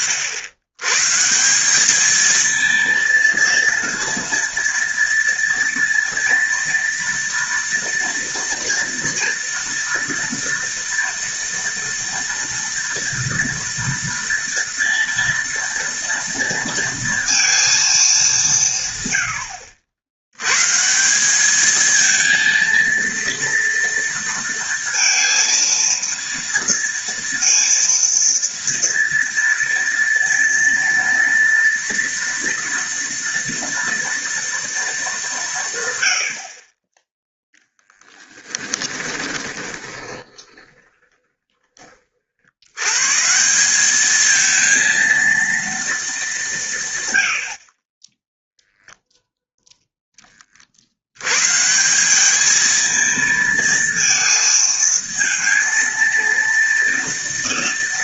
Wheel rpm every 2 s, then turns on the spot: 90, 230, 230, 230, 230, 230, 230, 230, 230, 150, 150, 230, 230, 230, 230, 230, 230, 220, 20, 10, 20, 110, 230, 160, 10, 70, 220, 220, 230.
38-42